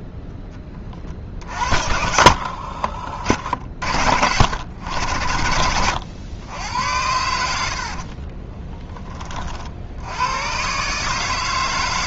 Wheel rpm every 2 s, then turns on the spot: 10, 60, 90, 100, 30, 110.
2-4 8-10